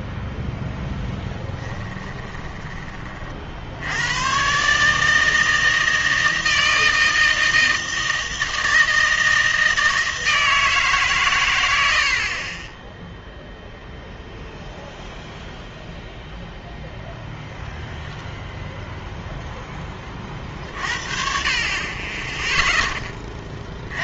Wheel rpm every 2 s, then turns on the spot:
0, 20, 140, 160, 160, 160, 30, 0, 0, 0, 50, 0.
none